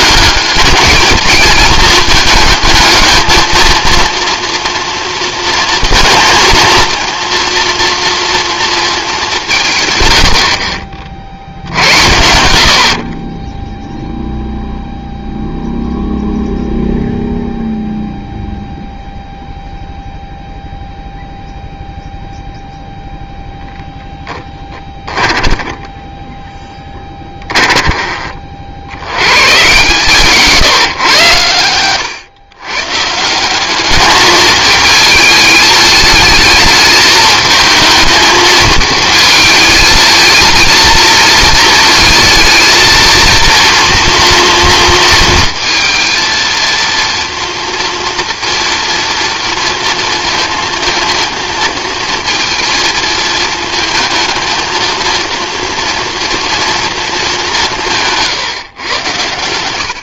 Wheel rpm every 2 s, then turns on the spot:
220, 220, 230, 230, 210, 50, 40, 0, 0, 0, 0, 0, 20, 10, 90, 130, 150, 220, 220, 220, 220, 230, 230, 230, 230, 230, 220, 230, 220, 120.
24-26